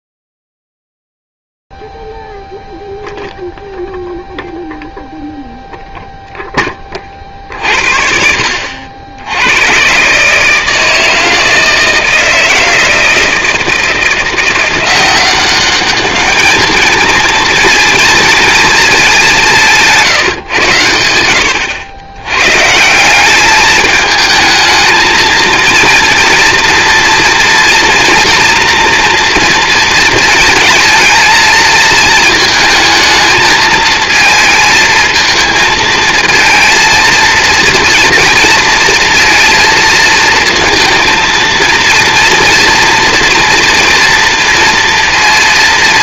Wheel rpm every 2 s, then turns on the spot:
0, 0, 0, 0, 50, 110, 160, 170, 200, 230, 160, 90, 210, 230, 240, 220, 220, 220, 220, 230, 220, 230, 240.
none